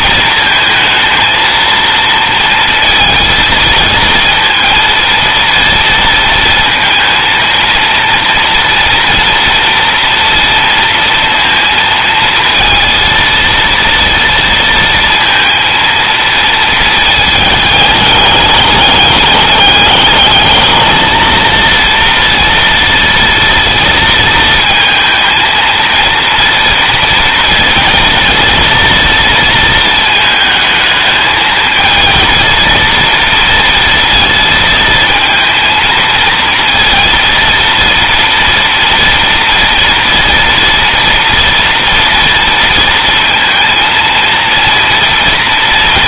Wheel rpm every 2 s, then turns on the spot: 220, 230, 230, 230, 230, 230, 230, 230, 220, 210, 220, 230, 230, 230, 230, 220, 230, 220, 230, 230, 230, 230, 230.
none